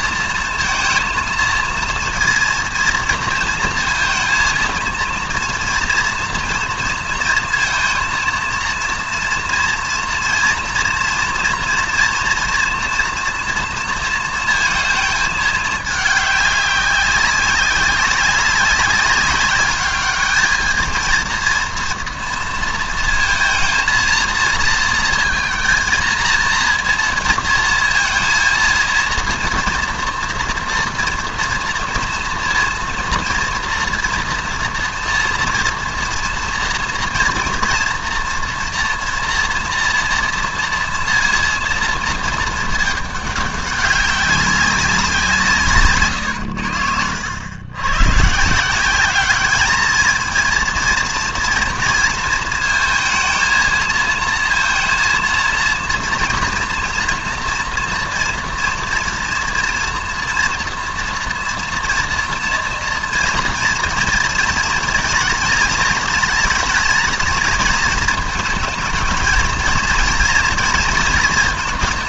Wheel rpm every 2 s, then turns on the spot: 230, 230, 230, 230, 230, 240, 230, 230, 200, 190, 220, 230, 230, 230, 230, 230, 230, 230, 230, 230, 230, 220, 190, 100, 170, 230, 230, 230, 230, 230, 230, 230, 230, 220, 220, 230.
none